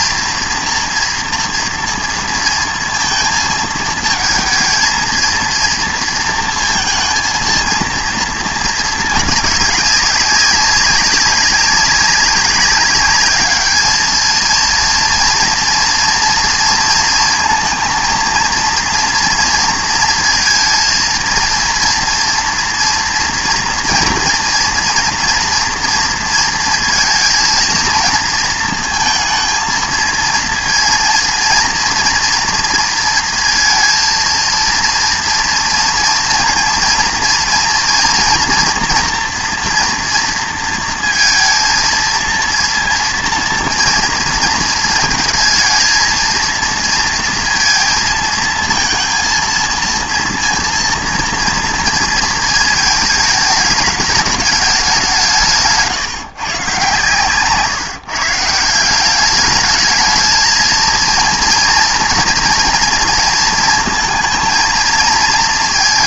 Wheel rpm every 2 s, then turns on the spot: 230, 230, 220, 230, 220, 200, 200, 230, 230, 230, 230, 230, 230, 230, 230, 230, 230, 230, 230, 230, 230, 230, 220, 230, 230, 230, 220, 210, 140, 170, 230, 230, 230.
none